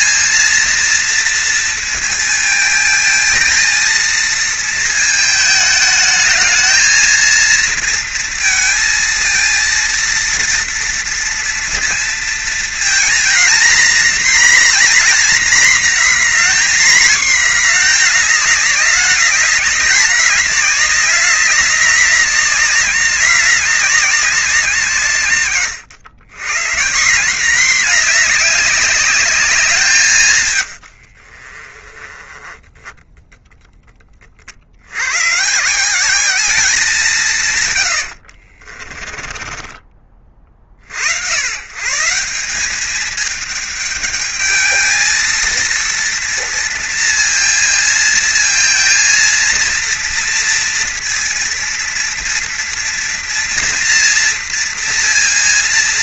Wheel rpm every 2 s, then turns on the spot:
230, 220, 220, 220, 220, 230, 230, 240, 240, 210, 200, 200, 170, 140, 200, 90, 10, 90, 200, 30, 50, 200, 220, 230, 230, 230, 230, 230.
30-34 38-40